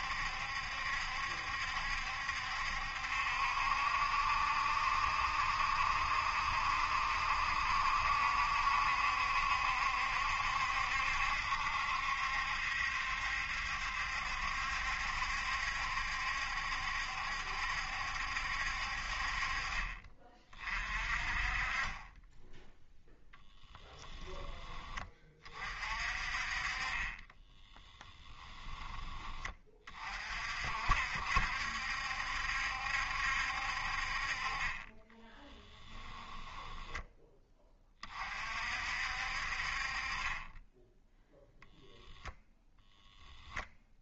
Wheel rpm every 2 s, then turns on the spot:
70, 70, 70, 70, 70, 70, 70, 70, 70, 60, 40, 0, 20, 30, 20, 60, 70, 20, 10, 60, 10, 0.
none